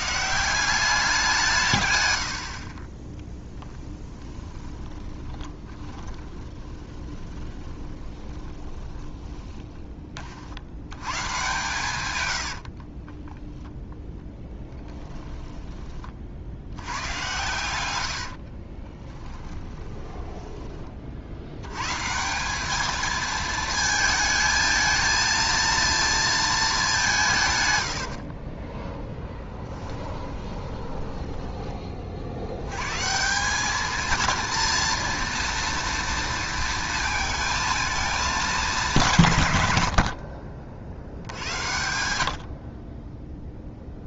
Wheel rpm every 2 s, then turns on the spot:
180, 50, 10, 20, 20, 80, 70, 10, 80, 30, 20, 200, 220, 210, 20, 20, 100, 230, 230, 200, 50, 40.
4-10 12-16 18-20 28-32